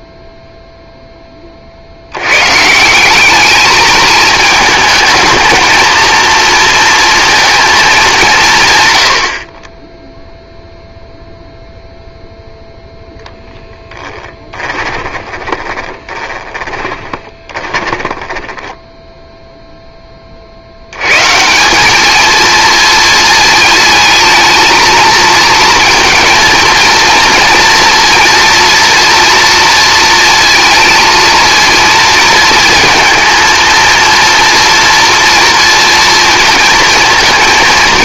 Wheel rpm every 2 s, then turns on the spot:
0, 180, 220, 230, 120, 0, 0, 20, 20, 10, 90, 220, 230, 230, 230, 230, 230, 230, 230.
14-20